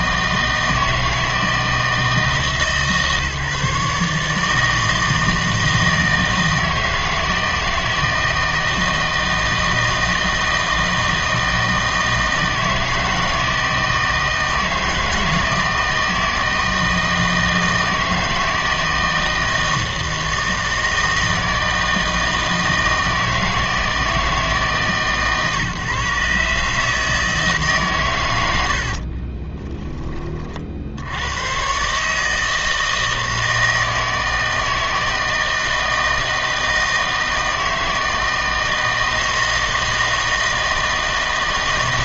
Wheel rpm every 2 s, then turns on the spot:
160, 150, 160, 160, 160, 160, 160, 160, 160, 160, 160, 160, 150, 150, 80, 50, 160, 160, 160, 160, 160.
none